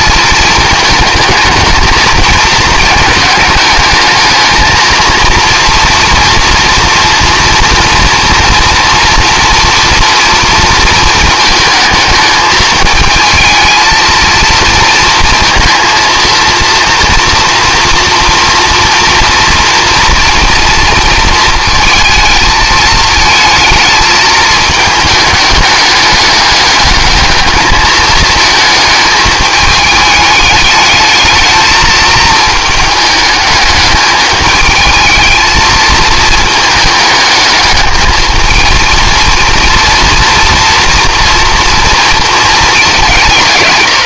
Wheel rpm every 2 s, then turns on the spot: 220, 220, 230, 230, 230, 230, 220, 230, 230, 230, 230, 220, 220, 210, 220, 210, 220, 220, 220, 220, 240, 210.
none